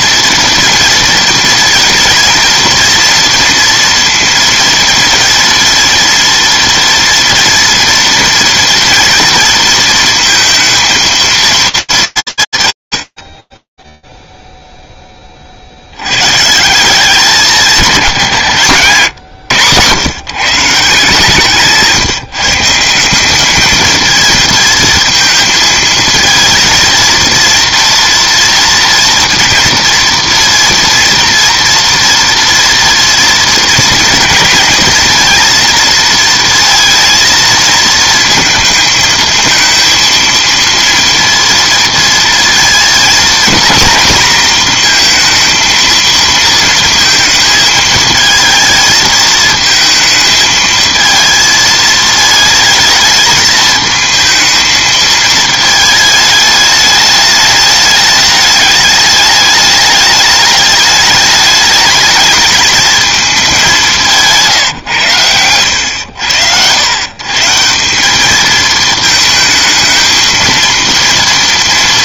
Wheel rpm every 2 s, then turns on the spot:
230, 230, 230, 230, 230, 230, 140, 0, 140, 170, 160, 160, 220, 230, 230, 230, 230, 230, 230, 220, 230, 230, 230, 230, 220, 220, 220, 220, 210, 210, 210, 210, 170, 90, 210, 230.
none